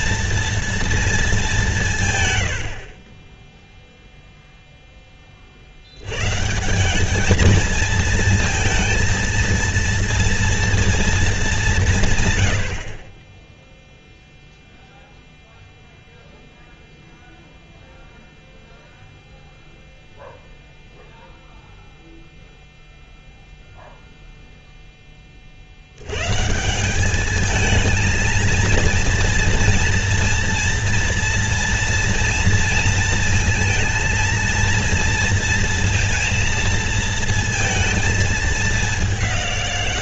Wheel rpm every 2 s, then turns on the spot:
230, 90, 0, 160, 230, 230, 110, 0, 0, 0, 0, 0, 0, 150, 230, 230, 230, 230, 230, 210.
none